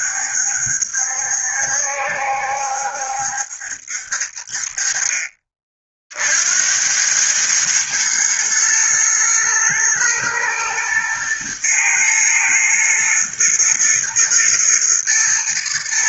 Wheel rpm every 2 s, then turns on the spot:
70, 70, 40, 100, 120, 110, 110, 110.
none